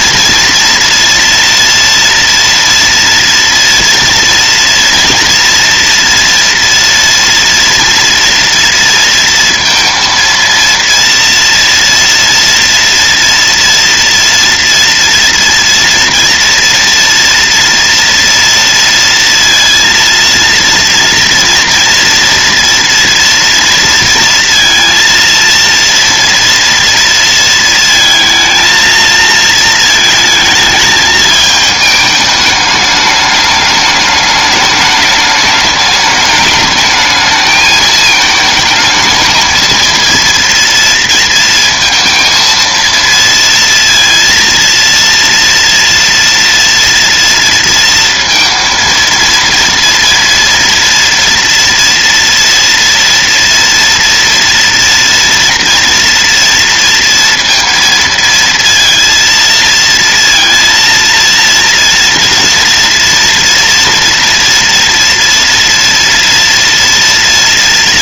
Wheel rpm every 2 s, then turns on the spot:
230, 230, 230, 230, 230, 230, 230, 230, 230, 230, 230, 230, 230, 240, 230, 220, 210, 210, 210, 220, 230, 230, 230, 230, 230, 230, 230, 230, 230, 230, 230, 230, 230, 240.
none